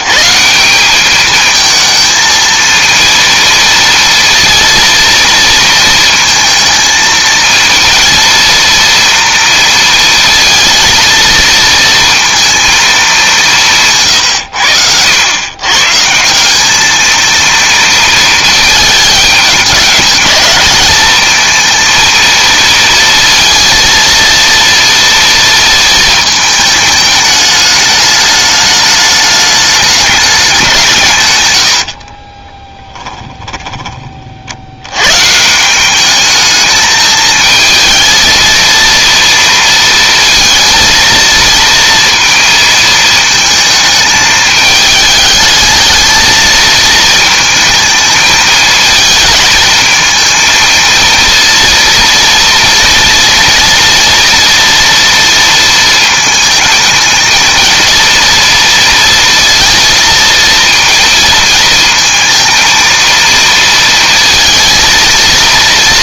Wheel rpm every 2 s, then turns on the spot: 190, 230, 230, 230, 230, 230, 220, 90, 210, 220, 220, 230, 230, 210, 210, 180, 10, 90, 210, 230, 230, 230, 210, 220, 220, 230, 230, 240, 220, 230, 230, 230, 230.
32-34